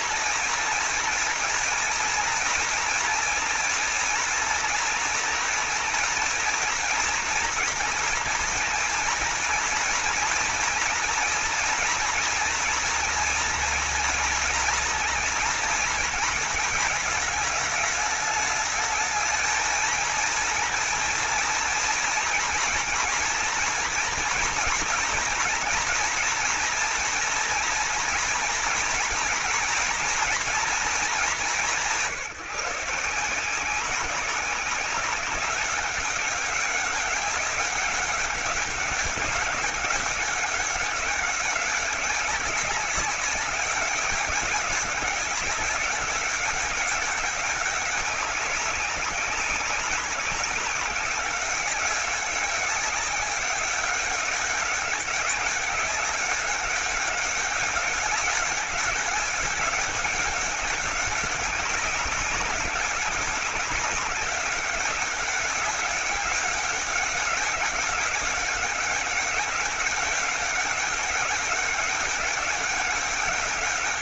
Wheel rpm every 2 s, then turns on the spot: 240, 230, 230, 240, 230, 230, 230, 230, 220, 220, 230, 230, 230, 240, 220, 220, 160, 190, 190, 200, 200, 200, 190, 200, 190, 190, 200, 200, 200, 210, 190, 200, 200, 190, 200, 200, 200.
none